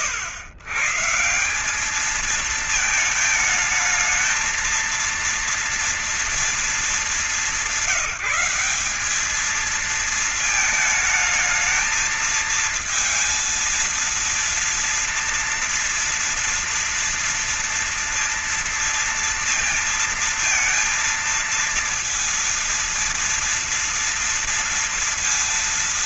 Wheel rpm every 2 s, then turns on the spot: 130, 220, 230, 220, 190, 220, 230, 230, 230, 230, 230, 230, 230.
none